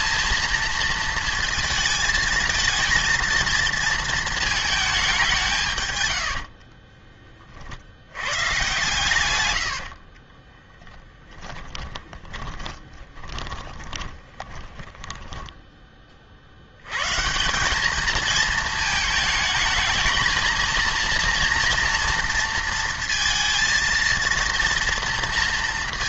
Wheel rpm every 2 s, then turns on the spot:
230, 220, 220, 60, 120, 10, 20, 20, 80, 220, 230, 230, 230.
6-8 10-16